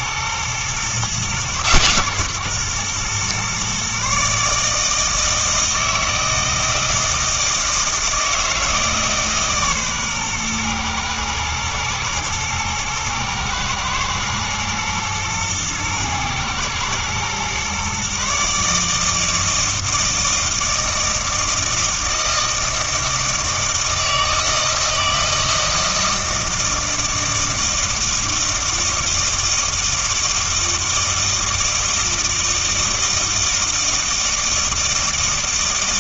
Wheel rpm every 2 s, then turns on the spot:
120, 130, 150, 160, 160, 120, 110, 120, 110, 150, 160, 160, 160, 160, 160, 160, 160, 160.
none